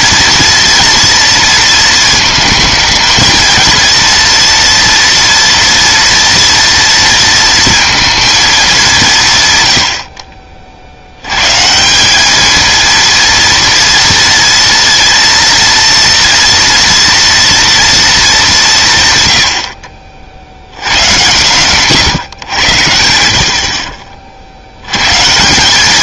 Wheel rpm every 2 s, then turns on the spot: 230, 220, 230, 230, 210, 50, 220, 230, 230, 180, 90, 100, 80.
none